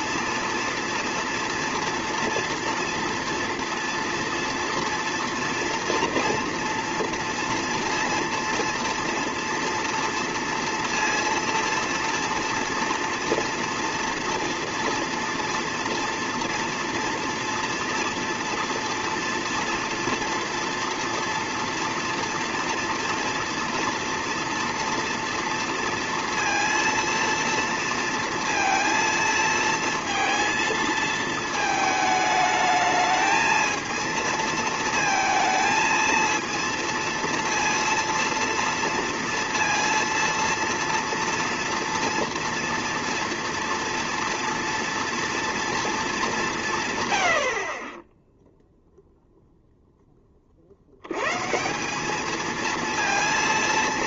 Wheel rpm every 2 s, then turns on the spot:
230, 230, 230, 230, 230, 230, 230, 230, 230, 230, 230, 230, 240, 230, 230, 230, 220, 230, 230, 230, 230, 230, 230, 160, 0, 60, 230.
none